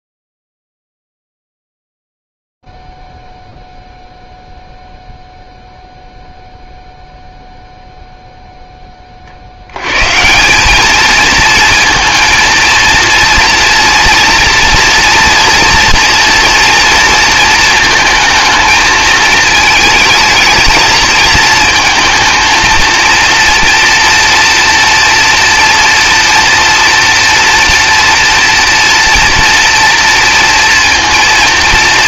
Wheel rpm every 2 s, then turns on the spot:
0, 0, 0, 0, 0, 110, 230, 230, 230, 220, 220, 220, 230, 240, 230, 230.
none